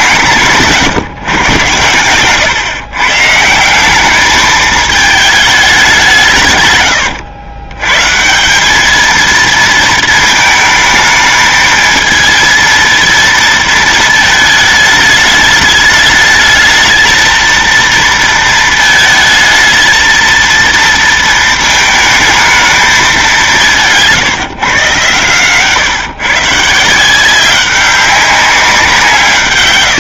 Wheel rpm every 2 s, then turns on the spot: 160, 120, 210, 120, 200, 220, 230, 220, 220, 220, 230, 220, 130, 160, 190.
none